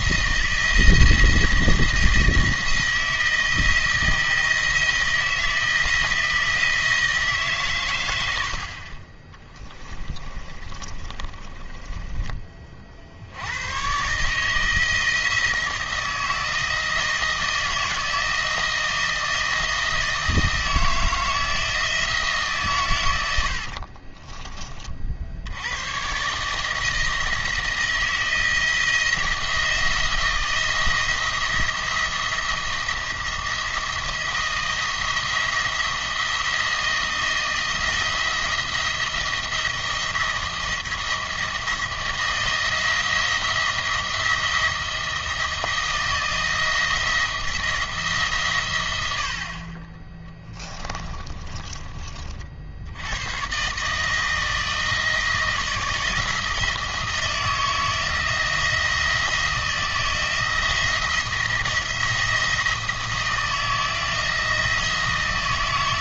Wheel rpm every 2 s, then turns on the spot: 170, 170, 170, 170, 60, 30, 40, 160, 170, 160, 160, 140, 30, 160, 160, 160, 170, 170, 160, 170, 170, 160, 170, 160, 120, 20, 60, 160, 160, 170, 170, 170, 170.
8-12 50-52